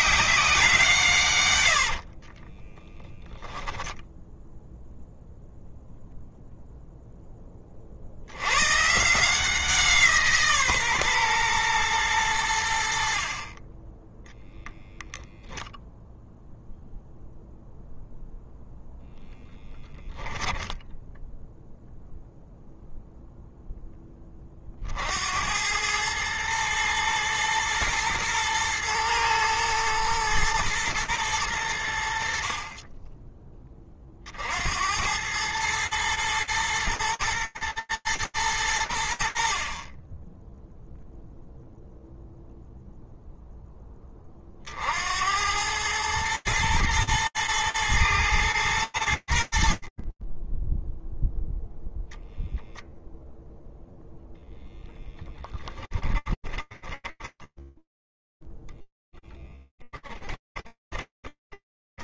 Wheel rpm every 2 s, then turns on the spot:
160, 20, 0, 0, 150, 140, 60, 0, 0, 0, 10, 0, 60, 110, 110, 110, 30, 90, 120, 80, 0, 0, 90, 120, 70, 0, 0, 10, 20, 0, 20.
2-4 54-58 60-62